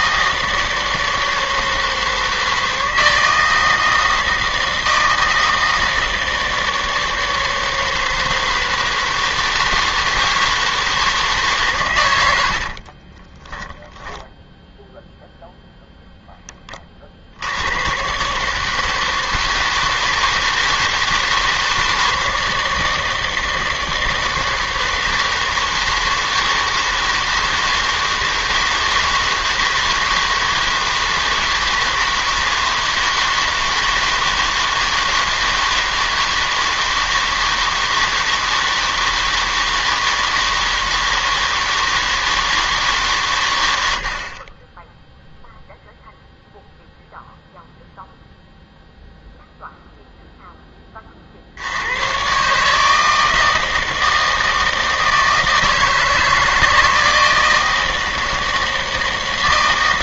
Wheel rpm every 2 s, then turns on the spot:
160, 160, 160, 160, 160, 160, 50, 0, 20, 150, 160, 160, 160, 160, 160, 160, 160, 160, 160, 160, 160, 150, 10, 0, 0, 20, 150, 160, 160, 160.
12-14